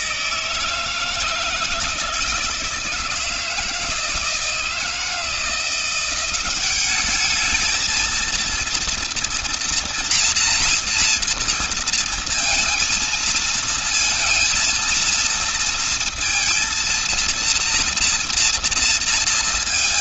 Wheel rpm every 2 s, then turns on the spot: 160, 160, 160, 200, 230, 230, 230, 230, 230, 230.
none